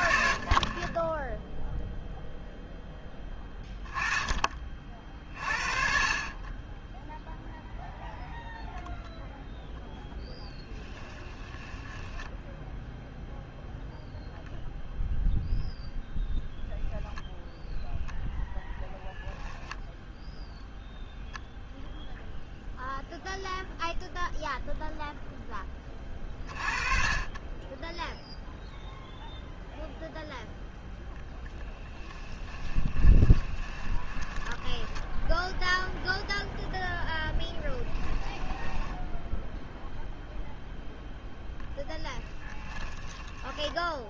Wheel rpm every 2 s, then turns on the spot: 40, 0, 20, 10, 0, 10, 0, 0, 10, 0, 0, 0, 0, 30, 0, 0, 20, 10, 10, 10, 0, 20.
10-12 32-40 42-44